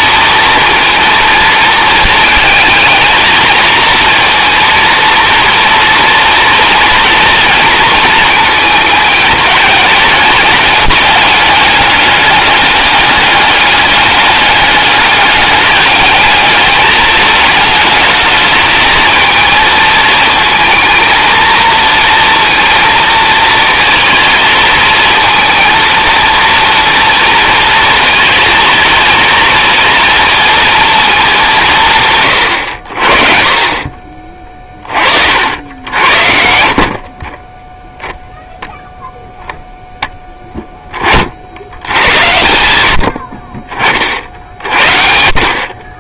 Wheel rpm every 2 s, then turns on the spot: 230, 220, 230, 230, 220, 210, 200, 200, 220, 220, 220, 220, 220, 230, 220, 230, 90, 30, 50, 0, 10, 80, 50.
none